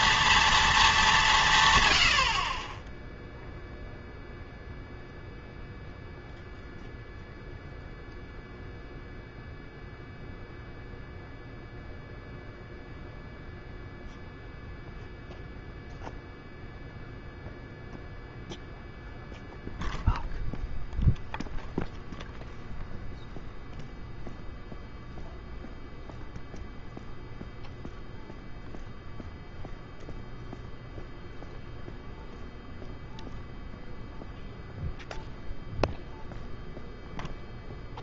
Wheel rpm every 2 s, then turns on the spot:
230, 50, 0, 0, 0, 0, 0, 0, 0, 0, 0, 0, 0, 0, 0, 0, 0, 0, 0.
none